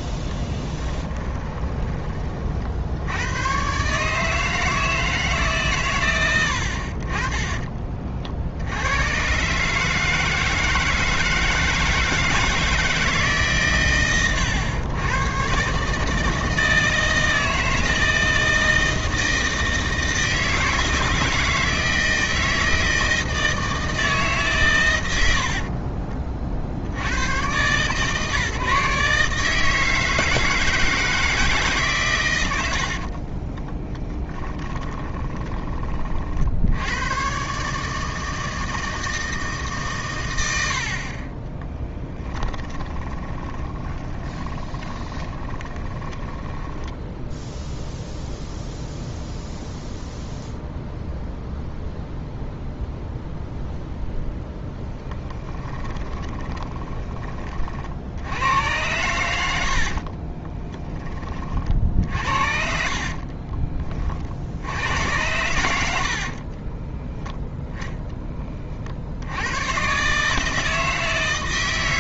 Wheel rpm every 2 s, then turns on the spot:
20, 60, 160, 80, 80, 160, 160, 110, 160, 160, 160, 160, 130, 50, 150, 160, 80, 20, 70, 160, 80, 20, 20, 10, 0, 0, 0, 10, 20, 100, 20, 50, 80, 20, 40, 160.
0-2 34-36 42-48 56-58 60-62 66-68